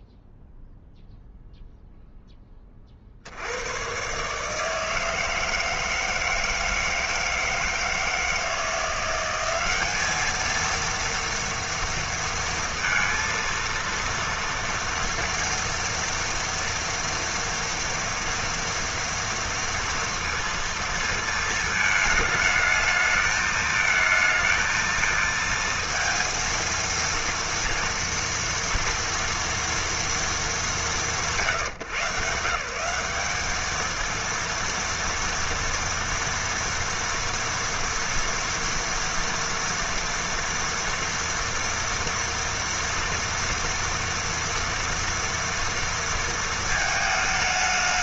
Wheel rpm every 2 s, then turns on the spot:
0, 30, 160, 160, 180, 230, 230, 230, 230, 230, 230, 220, 220, 230, 240, 180, 160, 230, 230, 240, 230, 230, 230, 220.
none